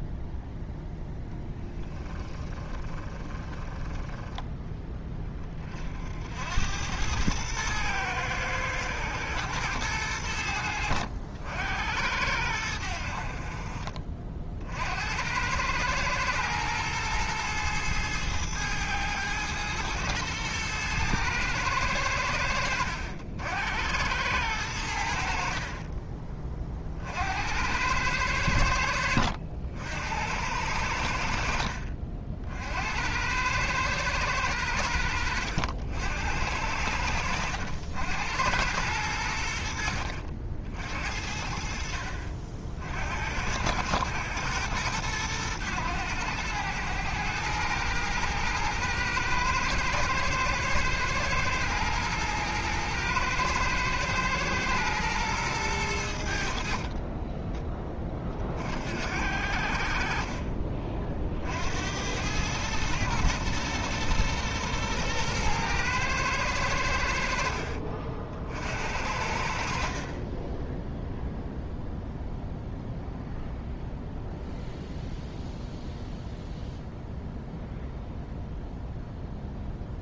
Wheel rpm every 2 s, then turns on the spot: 0, 20, 10, 90, 110, 80, 80, 60, 120, 110, 110, 80, 90, 30, 90, 90, 60, 90, 90, 100, 60, 60, 100, 90, 110, 110, 110, 120, 50, 50, 40, 110, 120, 100, 60, 10, 0, 0, 0, 0.
2-4 56-58